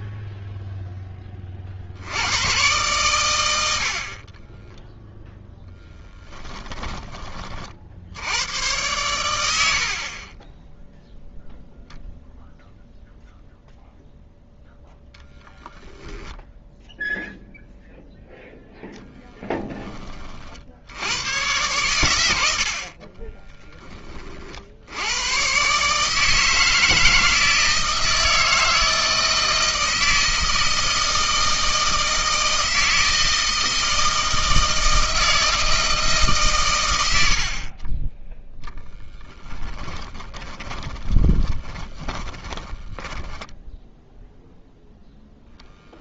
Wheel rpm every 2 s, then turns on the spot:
50, 90, 10, 50, 80, 0, 0, 0, 0, 20, 110, 10, 140, 160, 160, 160, 160, 160, 40, 10, 20, 10, 0.
4-6 38-44